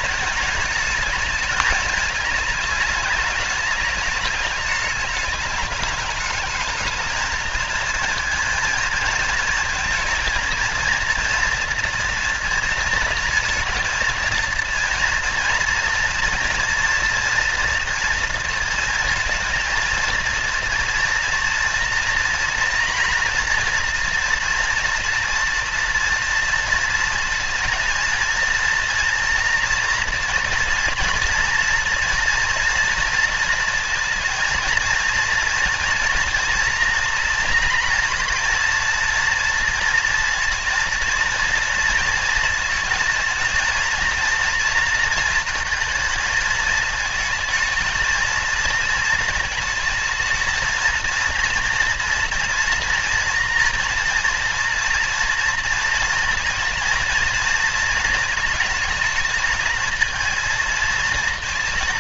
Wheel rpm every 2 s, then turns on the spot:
220, 210, 210, 220, 220, 230, 230, 230, 240, 230, 230, 230, 230, 230, 230, 230, 230, 230, 230, 230, 230, 220, 230, 220, 230, 220, 240, 230, 230, 220, 230.
none